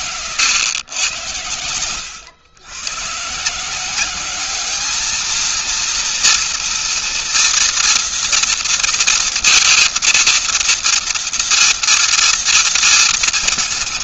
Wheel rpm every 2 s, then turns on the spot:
90, 160, 230, 240, 230, 230, 230.
none